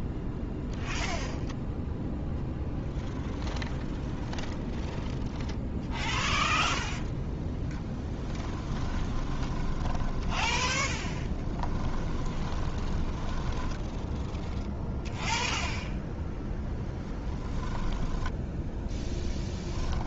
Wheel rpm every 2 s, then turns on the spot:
0, 0, 0, 0, 20, 10, 10, 0, 10, 10.
8-14 16-18